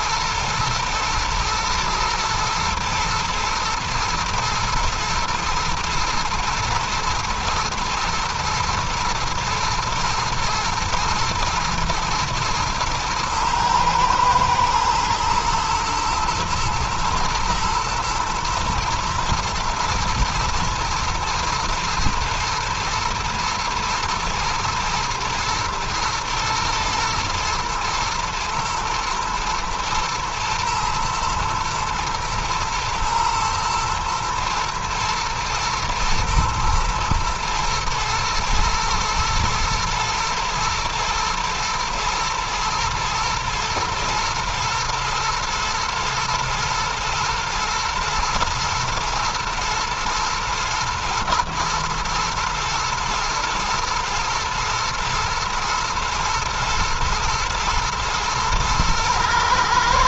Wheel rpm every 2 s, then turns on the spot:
110, 120, 120, 110, 120, 120, 110, 120, 110, 110, 120, 120, 110, 110, 110, 120, 120, 110, 110, 120, 120, 120, 120, 110, 120, 110, 110, 110, 110, 110.
none